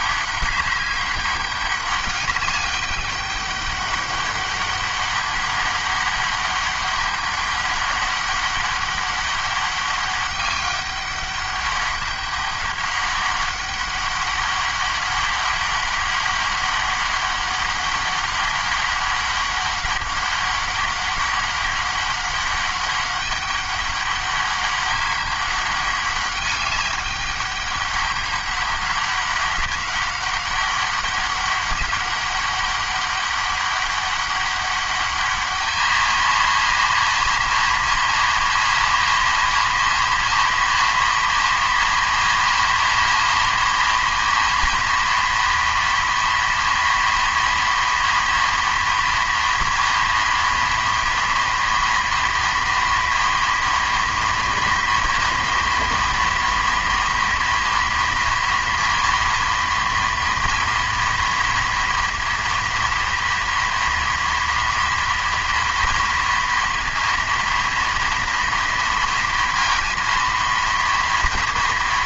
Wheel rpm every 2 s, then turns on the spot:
200, 200, 200, 200, 200, 200, 200, 200, 200, 200, 200, 200, 200, 200, 200, 200, 200, 200, 230, 230, 230, 230, 230, 230, 230, 230, 230, 230, 230, 230, 240, 230, 230, 230, 230, 230.
none